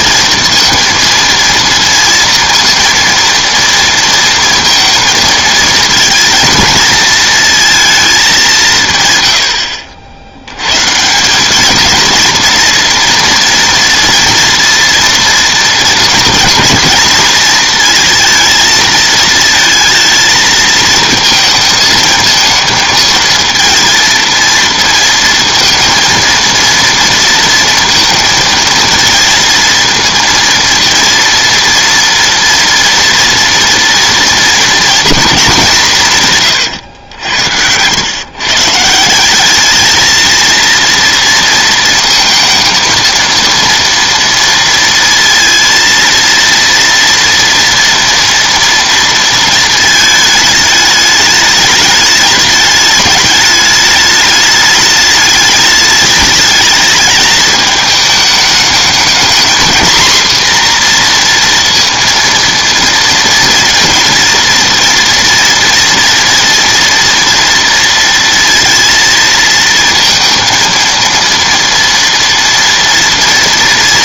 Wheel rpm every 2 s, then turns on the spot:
230, 230, 230, 230, 140, 140, 230, 230, 230, 220, 230, 230, 230, 230, 230, 230, 240, 230, 110, 160, 230, 230, 230, 230, 230, 210, 210, 210, 210, 220, 240, 230, 230, 230, 230, 230, 230.
none